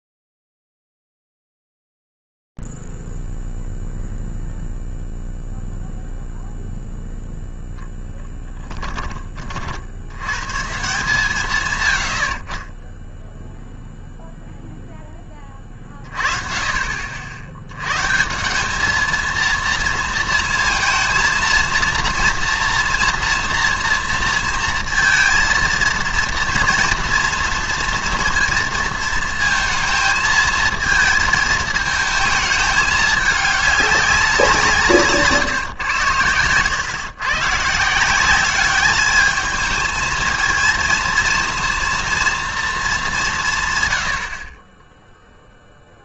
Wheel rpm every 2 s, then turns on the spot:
0, 0, 0, 0, 0, 70, 110, 0, 30, 150, 230, 230, 230, 230, 230, 220, 220, 190, 110, 180, 220, 230, 70.
none